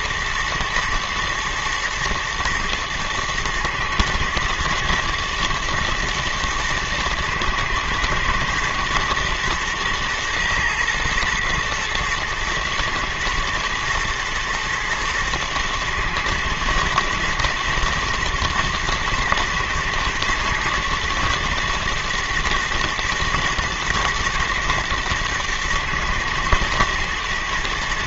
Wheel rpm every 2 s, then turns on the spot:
110, 110, 120, 110, 120, 120, 110, 110, 110, 120, 120, 110, 110, 110.
none